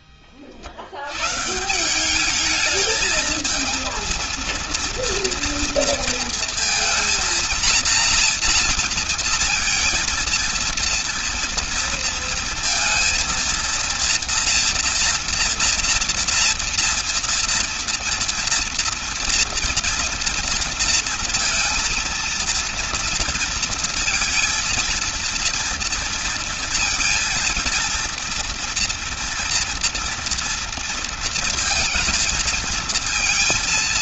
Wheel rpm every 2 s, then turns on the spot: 60, 210, 230, 230, 230, 230, 230, 230, 230, 230, 230, 230, 230, 230, 230, 230, 230.
none